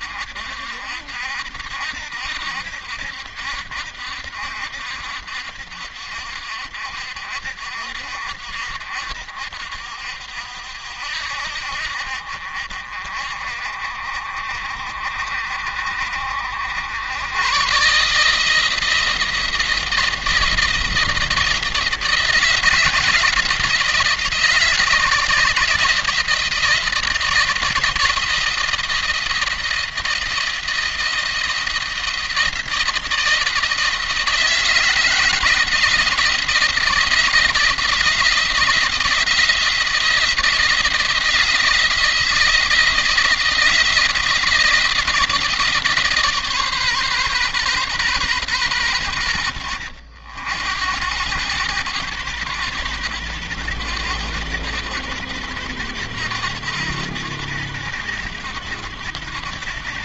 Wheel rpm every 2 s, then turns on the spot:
60, 70, 70, 60, 60, 70, 50, 50, 80, 160, 170, 160, 160, 160, 170, 170, 170, 160, 160, 170, 170, 160, 170, 140, 120, 80, 110, 100, 100, 90.
none